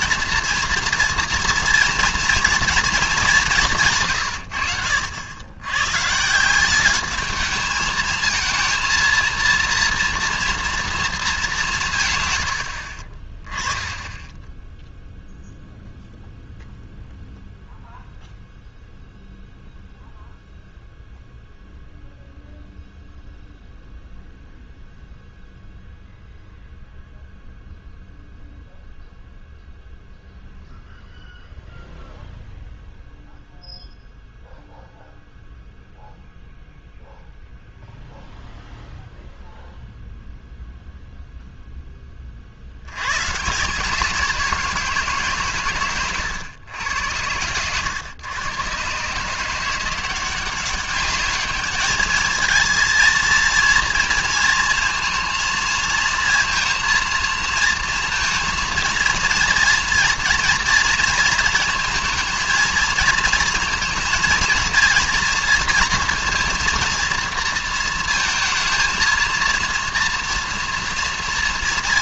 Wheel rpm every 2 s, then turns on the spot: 240, 230, 80, 190, 230, 230, 80, 10, 0, 0, 0, 0, 0, 0, 0, 0, 0, 0, 0, 0, 0, 60, 170, 100, 130, 190, 230, 230, 230, 230, 230, 230, 230, 230, 230, 240.
none